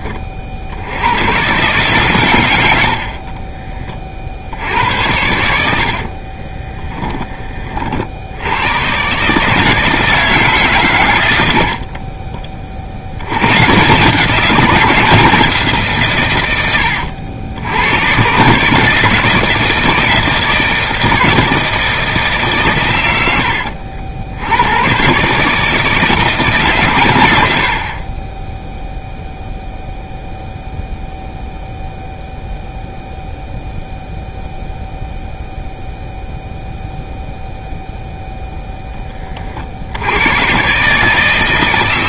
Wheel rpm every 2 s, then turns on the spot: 70, 60, 80, 20, 110, 130, 60, 170, 100, 160, 160, 110, 110, 130, 0, 0, 0, 0, 0, 10, 140.
6-8